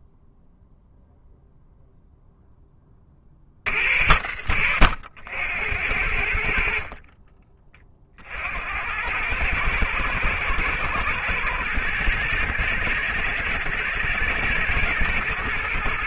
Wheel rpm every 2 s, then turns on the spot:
0, 10, 90, 40, 90, 110, 110, 120.
none